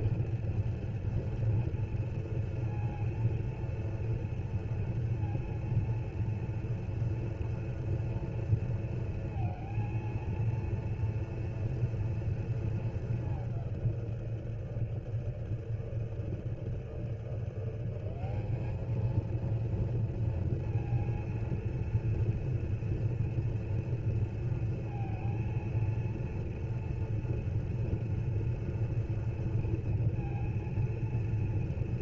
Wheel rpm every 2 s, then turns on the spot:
230, 230, 230, 230, 230, 230, 230, 160, 160, 200, 230, 230, 230, 230, 230, 230.
none